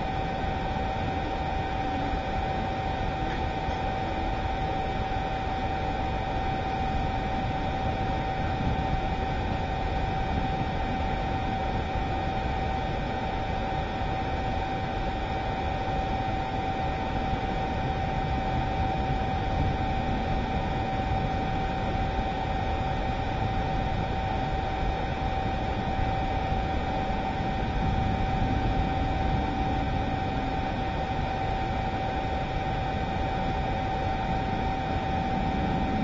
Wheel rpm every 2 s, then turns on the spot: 0, 0, 0, 0, 0, 0, 0, 0, 0, 0, 0, 0, 0, 0, 0, 0, 0, 0.
none